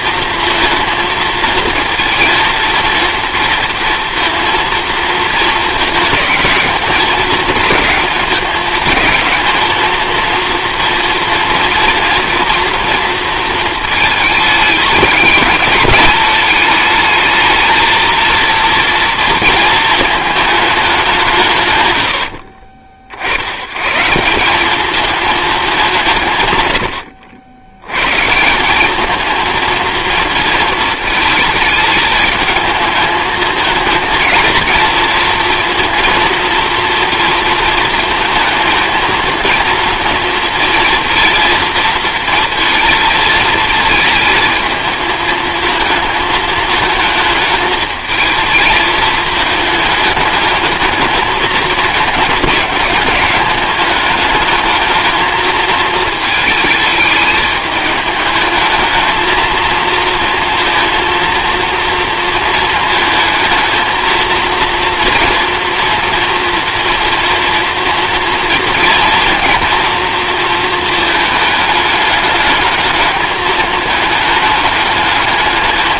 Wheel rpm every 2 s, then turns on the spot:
230, 230, 230, 220, 210, 240, 230, 210, 210, 230, 210, 50, 200, 110, 200, 220, 220, 230, 230, 230, 230, 230, 220, 220, 220, 210, 210, 220, 220, 220, 230, 230, 240, 230, 230, 230, 210, 210.
none